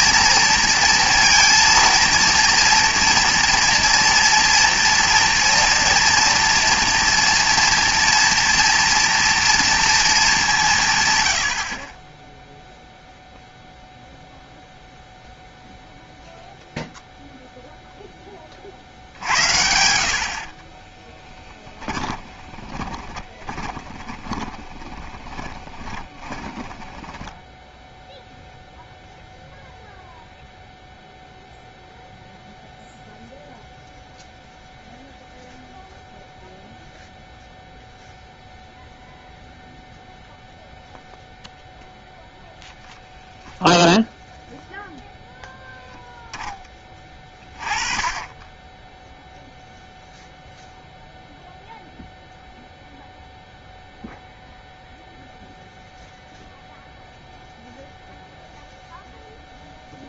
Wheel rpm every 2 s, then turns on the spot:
230, 230, 230, 230, 230, 160, 0, 0, 0, 50, 30, 10, 10, 20, 0, 0, 0, 0, 0, 0, 0, 0, 0, 10, 10, 0, 0, 0, 0, 0.
20-28